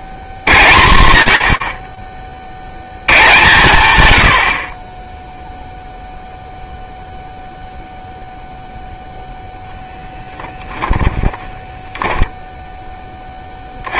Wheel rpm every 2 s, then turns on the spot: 80, 90, 30, 0, 0, 20, 50.
10-12